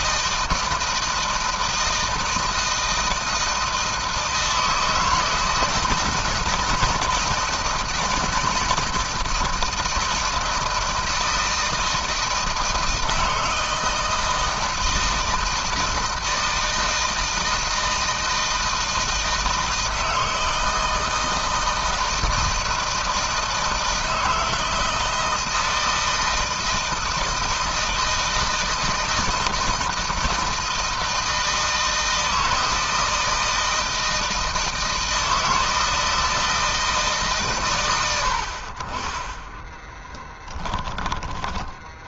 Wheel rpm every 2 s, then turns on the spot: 160, 160, 160, 160, 160, 160, 160, 160, 160, 160, 160, 160, 160, 160, 160, 160, 160, 160, 160, 40, 10.
38-40